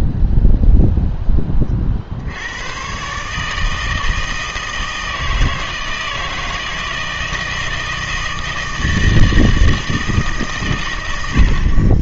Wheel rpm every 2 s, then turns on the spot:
0, 100, 160, 160, 160, 130.
none